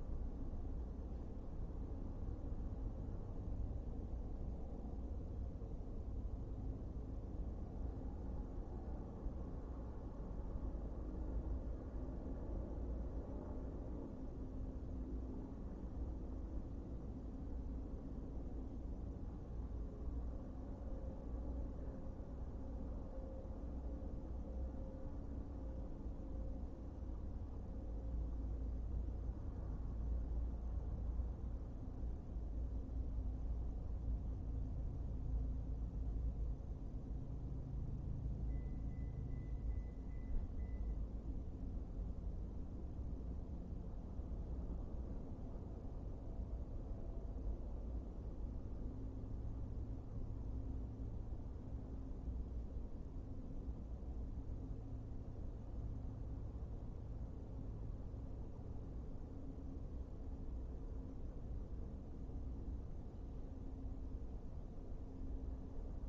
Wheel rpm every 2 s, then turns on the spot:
0, 0, 0, 0, 0, 0, 0, 0, 0, 0, 0, 0, 0, 0, 0, 0, 0, 0, 0, 0, 0, 0, 0, 0, 0, 0, 0, 0, 0, 0, 0, 0, 0.
none